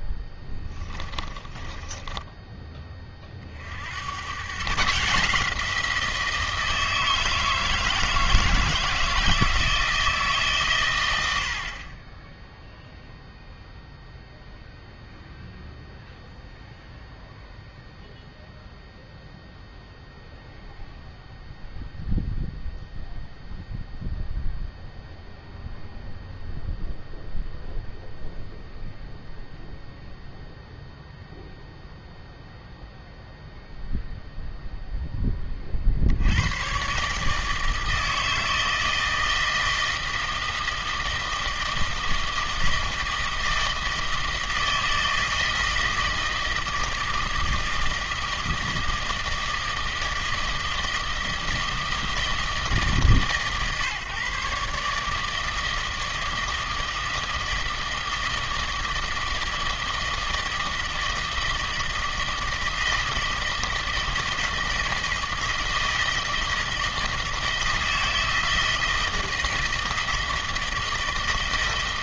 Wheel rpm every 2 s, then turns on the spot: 10, 20, 130, 170, 160, 130, 0, 0, 0, 0, 0, 0, 0, 0, 0, 0, 0, 0, 110, 160, 160, 160, 160, 160, 160, 160, 150, 140, 160, 160, 160, 160, 160, 160, 160, 160.
0-2